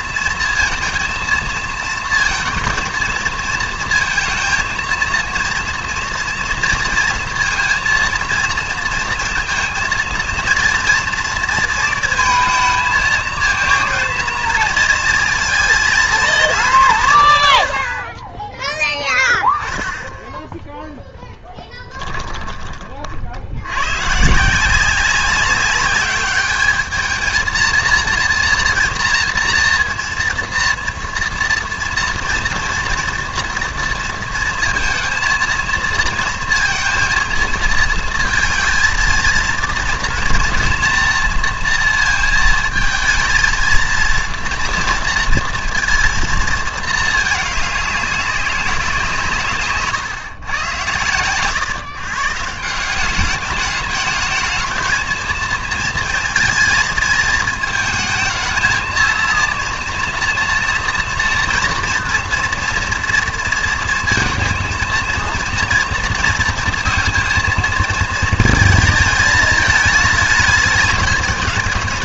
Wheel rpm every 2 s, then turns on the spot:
230, 220, 230, 230, 230, 230, 230, 230, 190, 10, 10, 20, 170, 210, 230, 230, 230, 230, 230, 230, 230, 220, 230, 220, 190, 120, 160, 220, 230, 220, 230, 230, 230, 230, 220, 220.
none